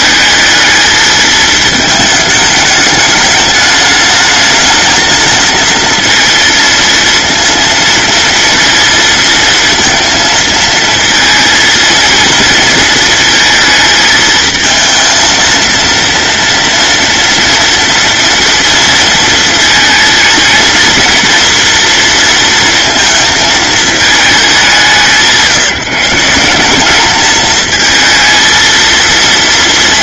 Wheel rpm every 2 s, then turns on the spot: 220, 210, 220, 230, 230, 220, 220, 220, 230, 230, 230, 230, 180, 200, 230.
none